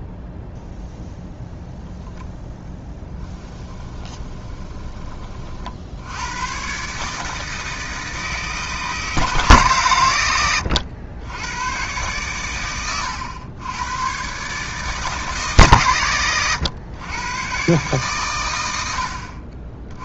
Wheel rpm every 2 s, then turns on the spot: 0, 10, 30, 150, 150, 90, 100, 150, 120, 70.
2-4